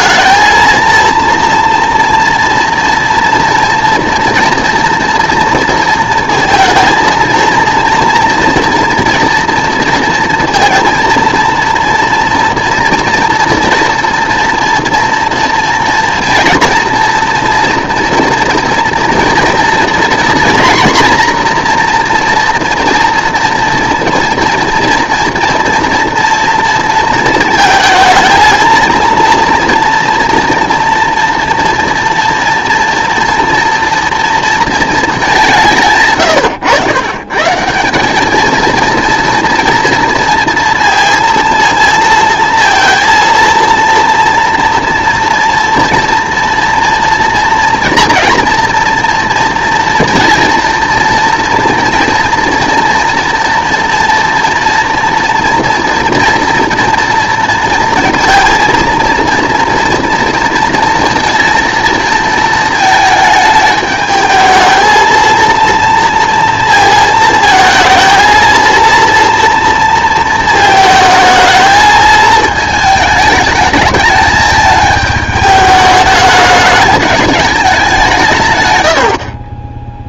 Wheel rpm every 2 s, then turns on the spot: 230, 230, 230, 230, 230, 230, 240, 240, 230, 230, 240, 230, 230, 230, 230, 240, 230, 230, 120, 220, 230, 230, 230, 230, 240, 230, 230, 240, 240, 230, 230, 220, 220, 230, 230, 220, 220, 220, 210, 120.
none